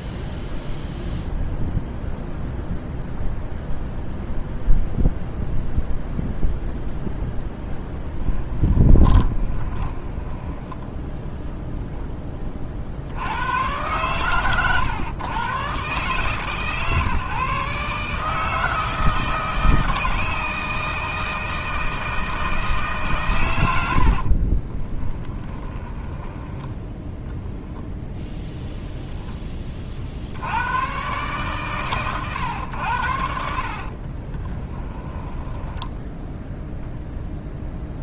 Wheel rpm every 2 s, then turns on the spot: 0, 0, 0, 0, 10, 10, 40, 120, 150, 160, 160, 160, 30, 10, 0, 90, 110, 20, 0.
8-10 24-26 34-36